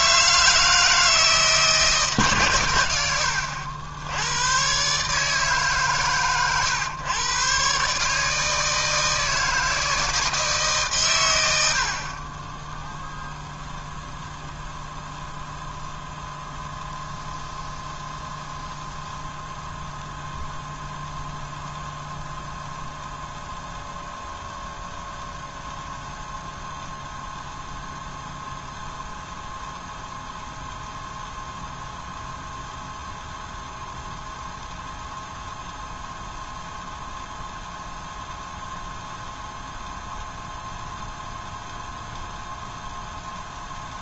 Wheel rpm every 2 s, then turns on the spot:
160, 100, 140, 120, 160, 130, 0, 0, 0, 0, 0, 0, 0, 0, 0, 0, 0, 0, 0, 0, 0, 0.
none